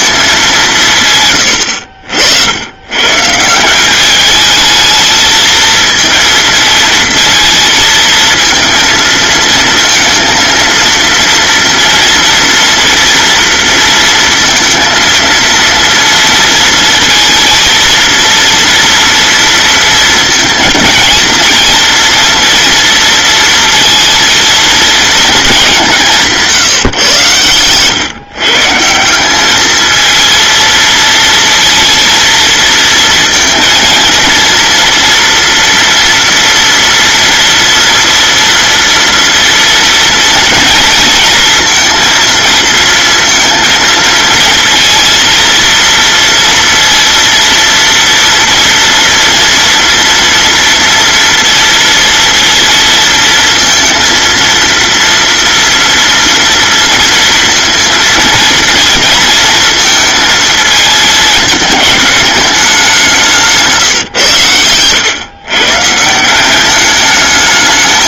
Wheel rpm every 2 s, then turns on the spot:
150, 120, 220, 230, 230, 230, 240, 230, 230, 230, 230, 230, 230, 140, 160, 230, 230, 230, 230, 230, 230, 220, 230, 230, 230, 230, 230, 230, 230, 230, 220, 190, 110, 210.
none